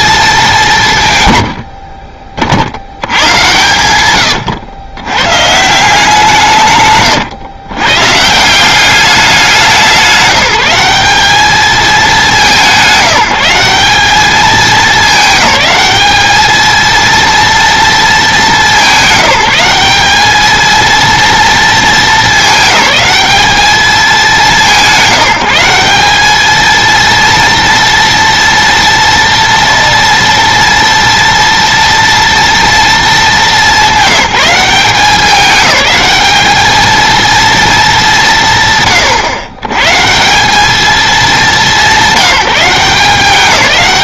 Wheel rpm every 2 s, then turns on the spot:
160, 80, 100, 140, 190, 200, 190, 210, 230, 200, 230, 210, 180, 230, 230, 230, 230, 190, 220, 130, 210, 180.
none